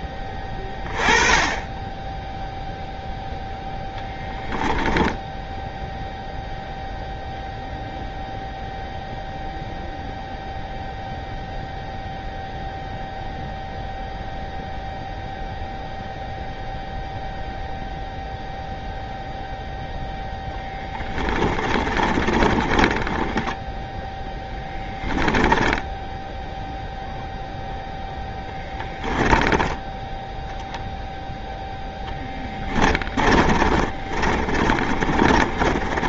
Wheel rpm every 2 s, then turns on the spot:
20, 0, 0, 0, 0, 0, 0, 0, 0, 0, 10, 30, 10, 0, 10, 0, 20, 30.
20-26 32-36